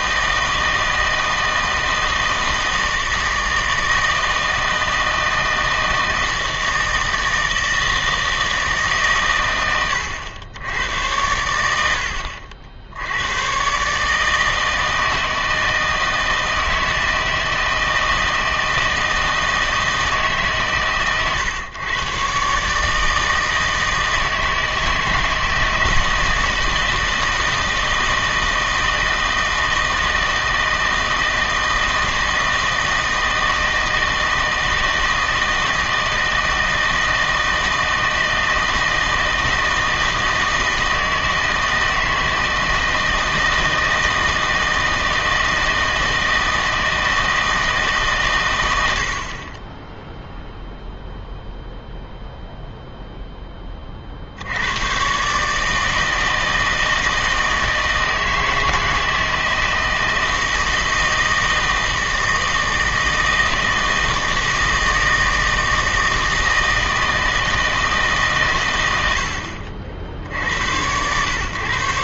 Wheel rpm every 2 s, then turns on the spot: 160, 160, 160, 160, 150, 100, 80, 160, 160, 160, 140, 150, 160, 160, 160, 160, 160, 160, 160, 160, 160, 160, 160, 160, 80, 0, 0, 120, 160, 160, 160, 160, 160, 160, 100, 100.
none